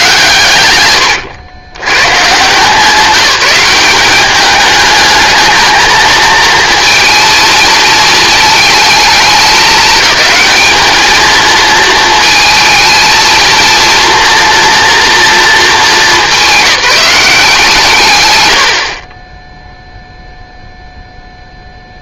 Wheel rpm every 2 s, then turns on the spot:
120, 170, 210, 230, 220, 220, 220, 230, 180, 70, 0.
none